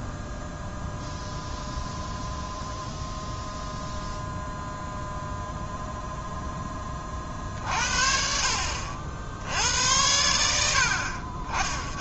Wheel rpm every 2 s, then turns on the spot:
0, 0, 0, 20, 60, 70.
none